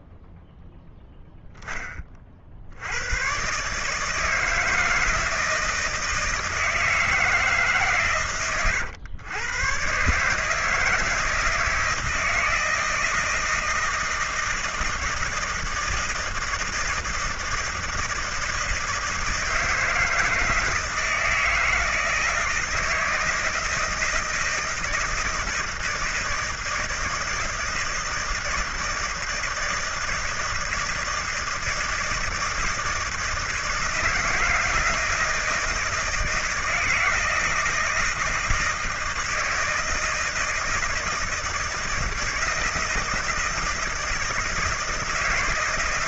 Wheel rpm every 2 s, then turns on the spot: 0, 80, 160, 160, 120, 150, 170, 160, 170, 160, 160, 160, 160, 160, 160, 160, 160, 160, 160, 160, 160, 160, 160.
none